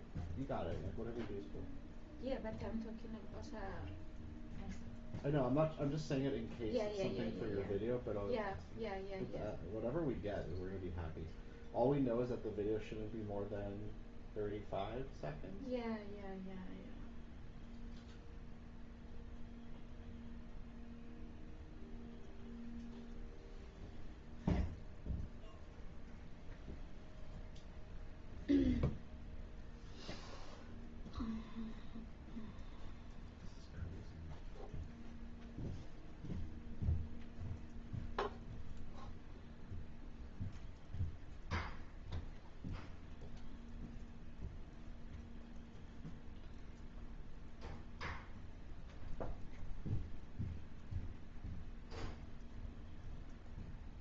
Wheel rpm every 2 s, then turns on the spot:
0, 0, 0, 0, 0, 0, 0, 0, 0, 0, 0, 0, 0, 0, 0, 0, 0, 0, 0, 0, 0, 0, 0, 0, 0, 0, 0.
none